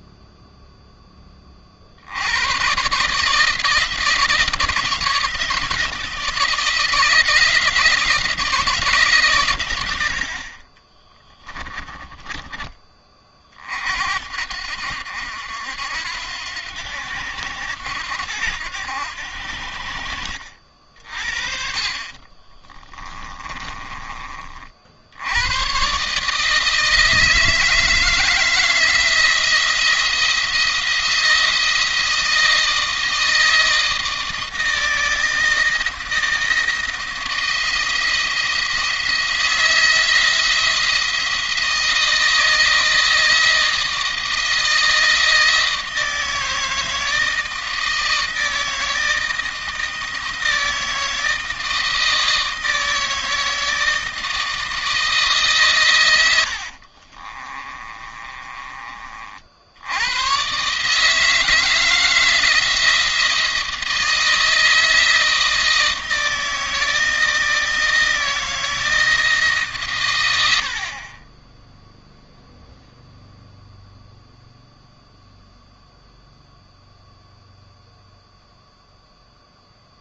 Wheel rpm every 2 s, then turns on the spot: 10, 130, 170, 160, 150, 20, 30, 70, 90, 80, 50, 30, 70, 160, 160, 170, 160, 160, 160, 170, 160, 160, 160, 160, 160, 160, 160, 160, 50, 40, 150, 160, 160, 160, 160, 50, 0, 0, 0, 0.
10-12 22-24 56-58 70-72